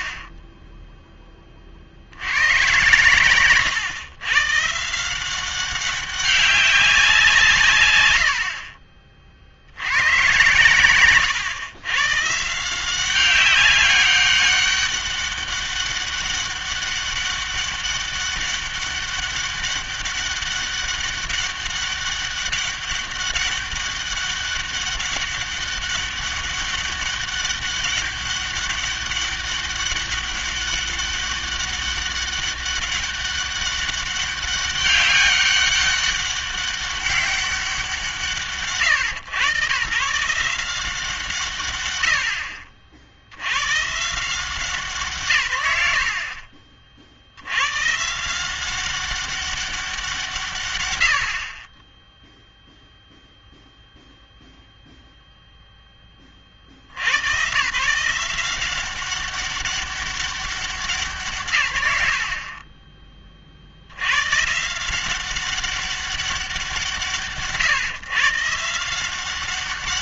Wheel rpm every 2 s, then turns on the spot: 20, 120, 140, 190, 40, 120, 170, 200, 200, 200, 200, 200, 200, 200, 200, 200, 200, 200, 200, 120, 180, 40, 160, 30, 180, 100, 0, 0, 60, 190, 180, 20, 160, 170, 170.
0-2